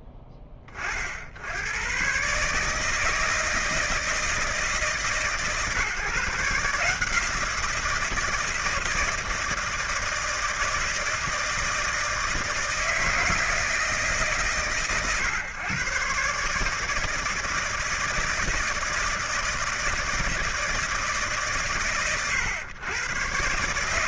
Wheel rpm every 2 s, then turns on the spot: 20, 150, 150, 160, 160, 160, 160, 140, 150, 160, 160, 120.
none